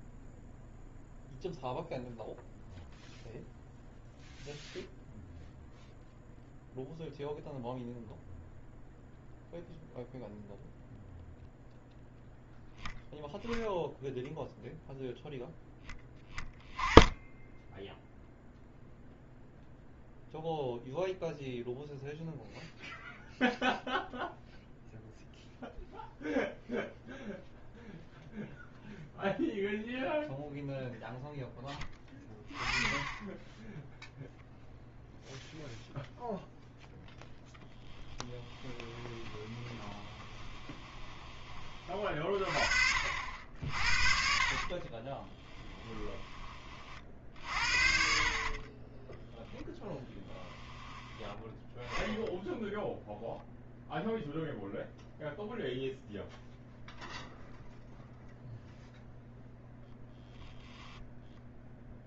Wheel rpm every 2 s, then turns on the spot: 0, 0, 0, 0, 0, 0, 0, 0, 10, 0, 0, 0, 0, 0, 0, 0, 20, 0, 0, 20, 20, 30, 40, 30, 30, 10, 0, 0, 0, 0, 0.
38-42 44-46 48-50